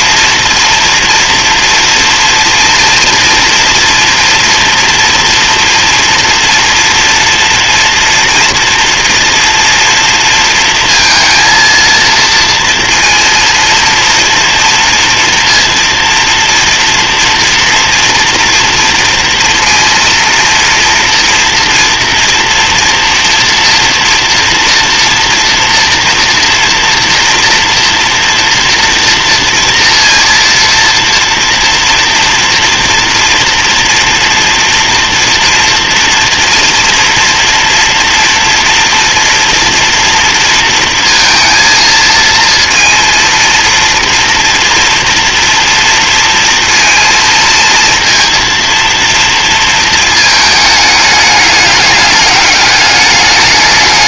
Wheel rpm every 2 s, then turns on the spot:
230, 230, 230, 240, 240, 230, 230, 230, 230, 230, 240, 230, 230, 230, 230, 230, 230, 230, 230, 230, 230, 230, 230, 230, 230, 210, 200.
none